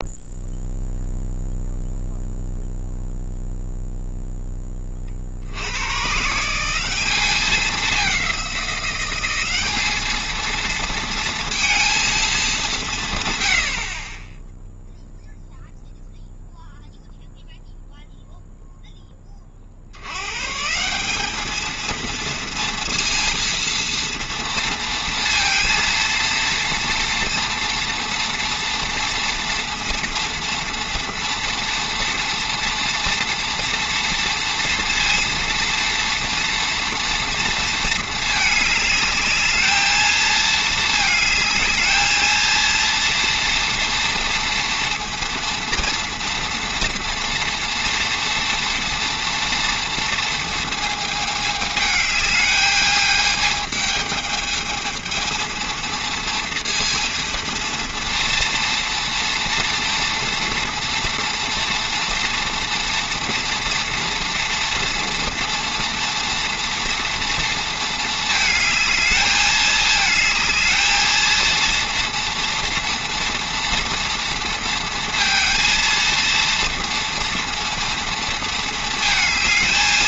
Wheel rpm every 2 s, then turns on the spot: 0, 0, 10, 170, 190, 230, 200, 0, 0, 0, 150, 230, 230, 230, 230, 230, 230, 230, 230, 210, 220, 230, 230, 230, 230, 230, 210, 220, 230, 230, 230, 230, 230, 230, 220, 220, 230, 230, 230, 230.
none